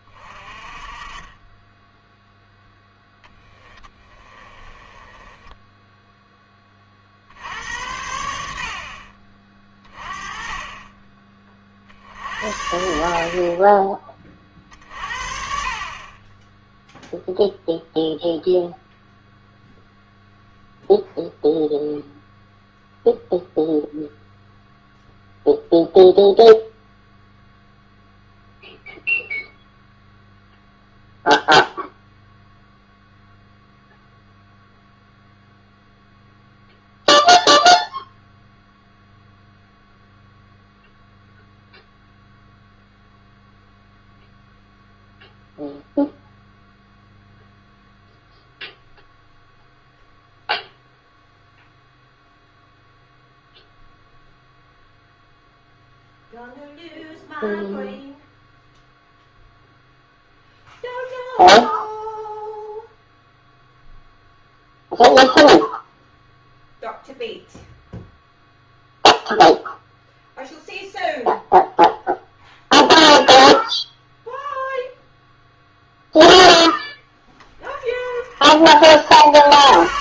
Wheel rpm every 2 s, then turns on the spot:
30, 0, 20, 30, 50, 20, 60, 50, 0, 0, 0, 0, 0, 0, 0, 0, 0, 0, 0, 0, 0, 0, 0, 0, 0, 0, 0, 0, 0, 0, 0, 0, 0, 0, 0, 0, 0, 0, 10, 50.
4-6